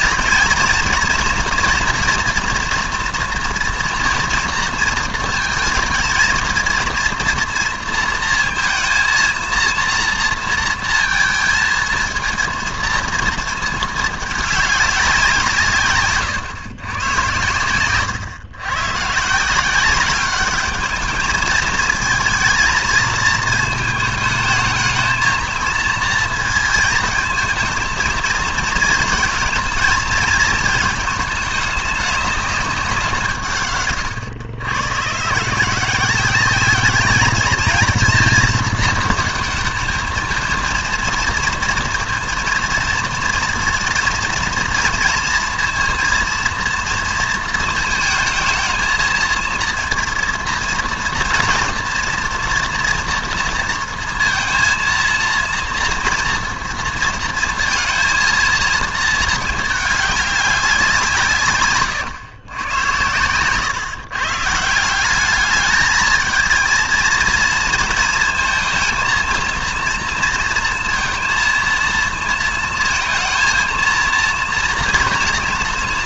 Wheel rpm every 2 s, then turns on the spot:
230, 240, 230, 230, 230, 230, 230, 200, 120, 120, 210, 230, 220, 220, 230, 220, 190, 120, 210, 220, 220, 230, 230, 230, 230, 230, 240, 230, 230, 230, 190, 100, 160, 230, 230, 230, 230, 230.
none